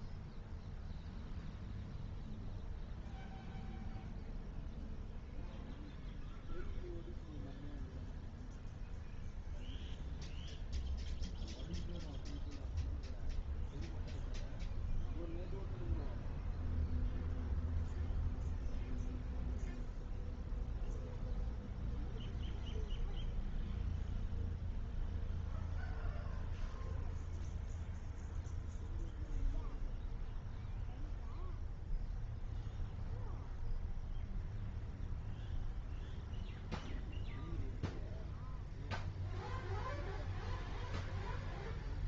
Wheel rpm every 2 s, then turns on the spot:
0, 0, 0, 0, 0, 0, 0, 0, 0, 0, 0, 0, 0, 0, 0, 0, 0, 0, 0, 0, 0.
none